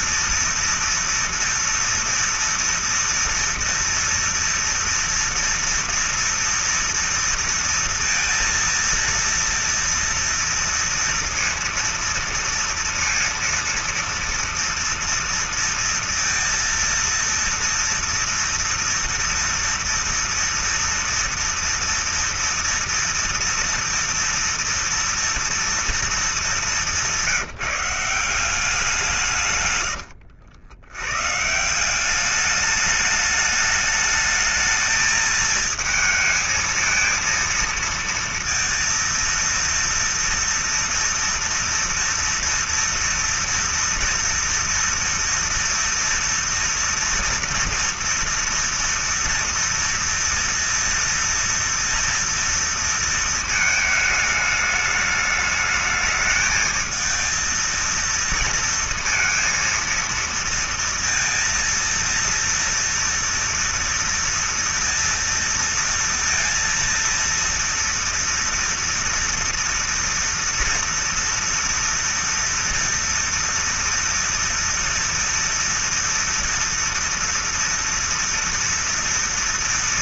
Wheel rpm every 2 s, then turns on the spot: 230, 230, 230, 230, 230, 230, 230, 230, 230, 230, 230, 230, 230, 220, 180, 90, 190, 210, 220, 230, 230, 230, 230, 230, 230, 230, 230, 210, 220, 230, 230, 230, 230, 230, 230, 230, 230, 230, 230, 230.
30-32